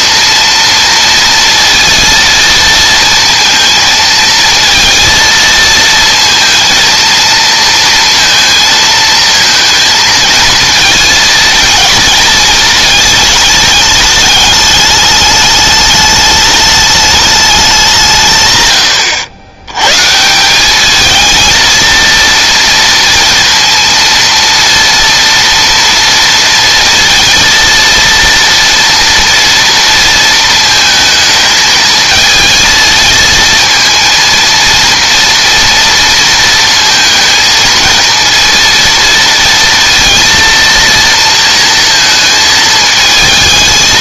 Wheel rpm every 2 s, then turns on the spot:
230, 230, 230, 230, 230, 230, 220, 210, 210, 110, 200, 230, 230, 230, 230, 220, 230, 230, 230, 230, 230, 220.
none